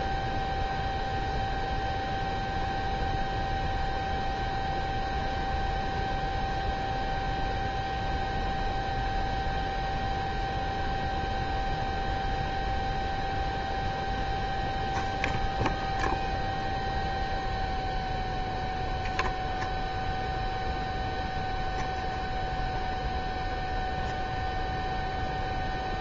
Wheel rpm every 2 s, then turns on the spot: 0, 0, 0, 0, 0, 0, 0, 0, 0, 0, 0, 0, 0.
none